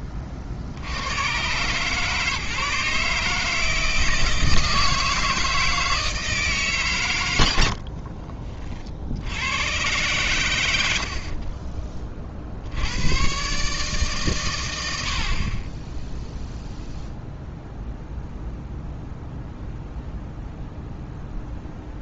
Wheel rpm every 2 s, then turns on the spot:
30, 150, 160, 150, 40, 100, 60, 110, 0, 0, 0.
none